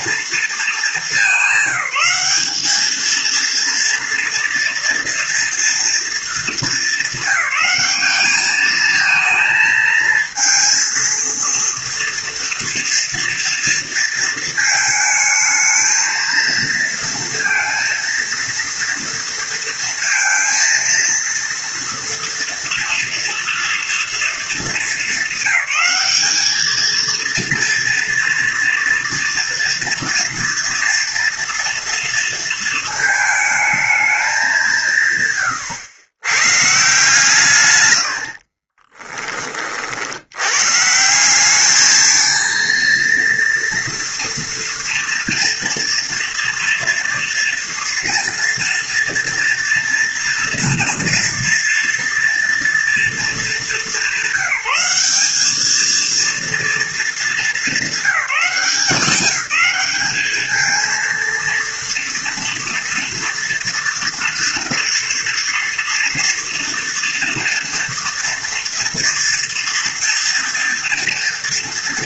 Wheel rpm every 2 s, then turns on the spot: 220, 220, 230, 200, 220, 230, 230, 220, 230, 230, 230, 230, 220, 230, 230, 230, 220, 140, 150, 30, 150, 230, 230, 230, 230, 230, 220, 200, 220, 180, 230, 240, 230, 230, 230, 230.
38-40